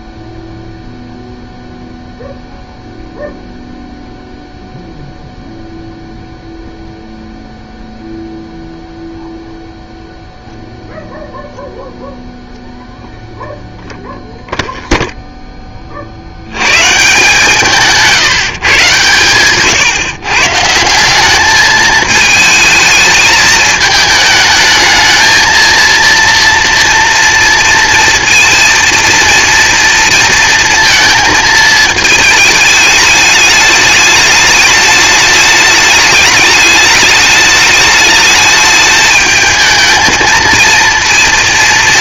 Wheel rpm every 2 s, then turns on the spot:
0, 0, 0, 0, 0, 0, 0, 0, 120, 150, 150, 220, 210, 230, 230, 230, 210, 210, 210, 220, 230.
none